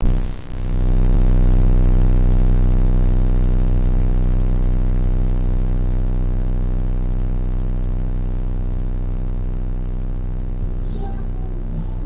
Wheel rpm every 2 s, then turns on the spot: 0, 0, 0, 0, 0, 0.
none